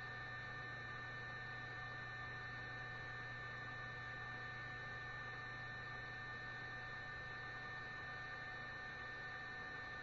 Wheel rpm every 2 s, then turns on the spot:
0, 0, 0, 0, 0.
none